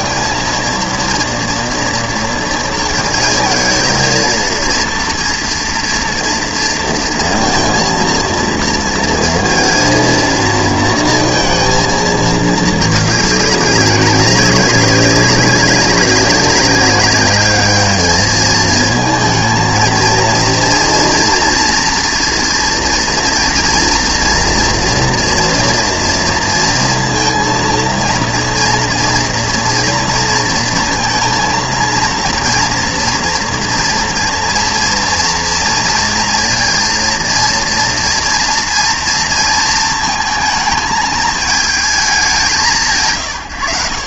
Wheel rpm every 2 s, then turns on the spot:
230, 230, 230, 230, 230, 220, 210, 200, 190, 220, 230, 230, 240, 230, 230, 230, 230, 230, 230, 230, 220, 170.
none